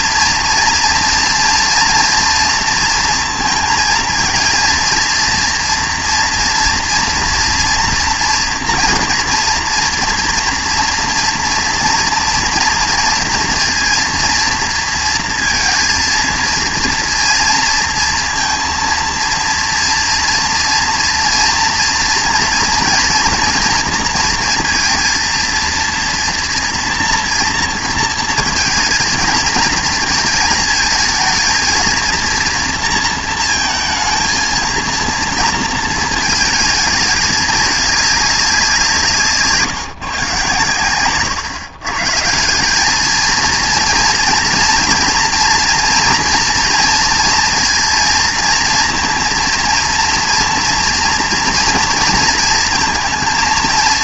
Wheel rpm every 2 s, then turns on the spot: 230, 230, 230, 230, 240, 230, 230, 230, 230, 230, 230, 230, 230, 240, 230, 230, 230, 230, 220, 190, 130, 190, 230, 230, 230, 230, 230.
none